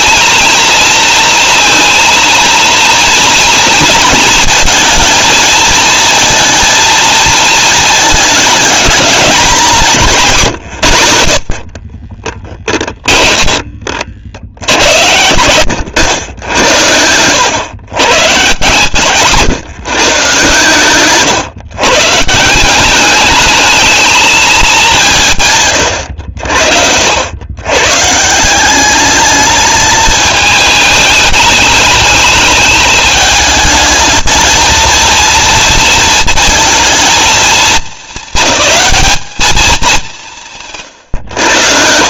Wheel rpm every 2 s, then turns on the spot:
230, 230, 230, 230, 220, 130, 10, 80, 90, 130, 130, 180, 210, 70, 190, 210, 210, 230, 220, 210, 160.
12-14